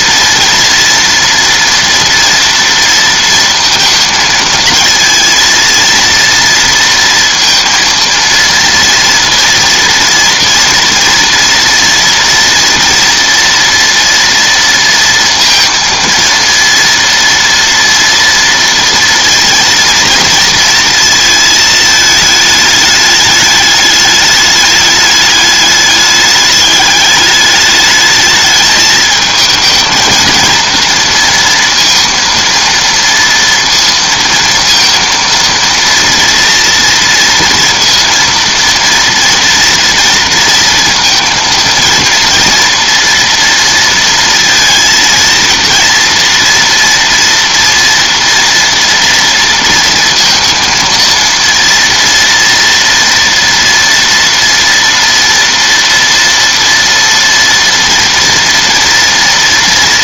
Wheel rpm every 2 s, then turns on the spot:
230, 230, 220, 230, 230, 230, 230, 230, 230, 230, 230, 210, 210, 210, 220, 230, 230, 230, 230, 230, 230, 230, 230, 230, 230, 230, 230, 230, 230, 230.
none